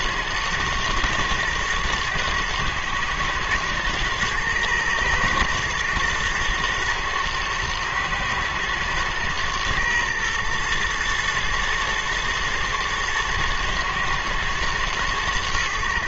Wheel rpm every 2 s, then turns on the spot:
120, 110, 120, 110, 120, 110, 110, 110.
none